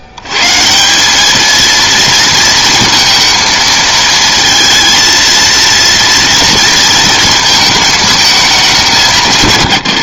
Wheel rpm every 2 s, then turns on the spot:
80, 230, 230, 220, 210.
none